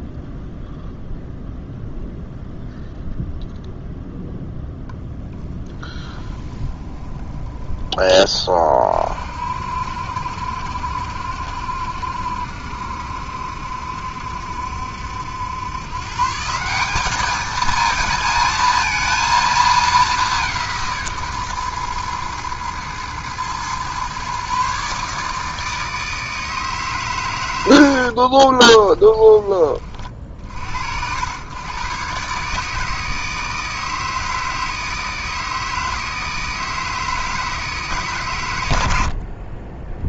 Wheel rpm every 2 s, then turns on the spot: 0, 0, 0, 10, 40, 70, 70, 70, 200, 230, 160, 110, 140, 130, 20, 90, 150, 160, 160, 80.
6-8 28-30